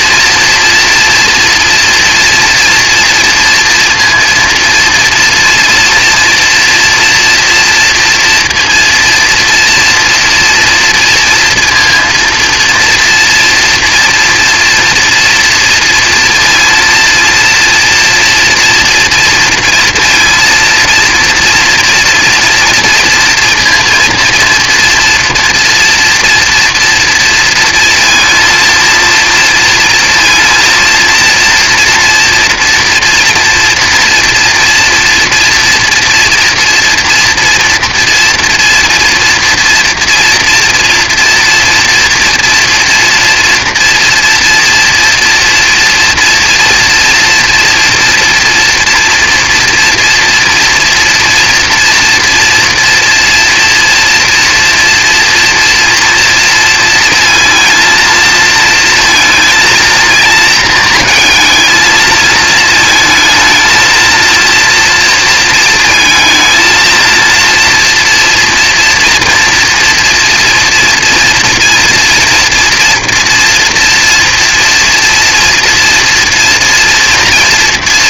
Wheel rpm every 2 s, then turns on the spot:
230, 230, 230, 240, 230, 230, 230, 230, 230, 230, 230, 230, 230, 230, 230, 230, 230, 230, 240, 240, 240, 230, 240, 230, 240, 240, 230, 230, 230, 230, 230, 220, 230, 230, 240, 230, 240, 240, 240.
none